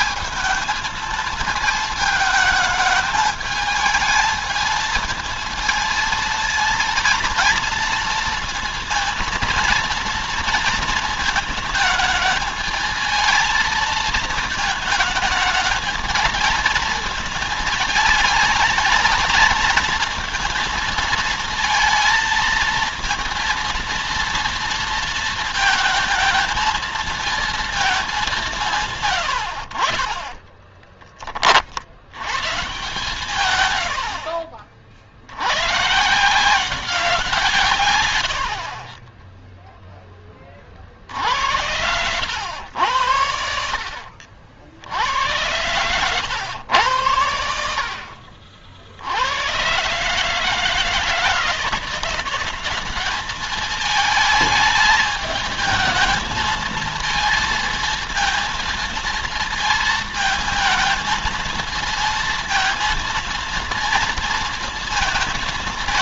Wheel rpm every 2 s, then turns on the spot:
220, 220, 220, 230, 230, 230, 220, 220, 220, 220, 230, 230, 230, 230, 140, 10, 150, 60, 180, 40, 50, 90, 80, 100, 60, 160, 190, 210, 220, 230, 220, 230, 220.
38-40